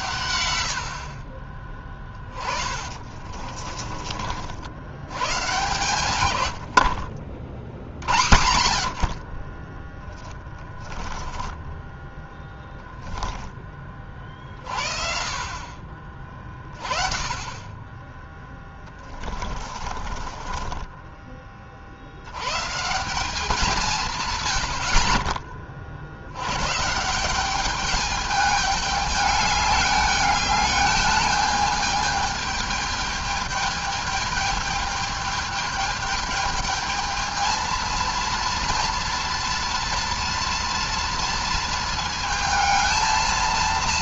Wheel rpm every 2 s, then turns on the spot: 100, 40, 60, 100, 90, 20, 10, 40, 30, 10, 20, 130, 100, 120, 210, 210, 210, 210, 210, 230, 230, 220.
0-4 10-14 18-22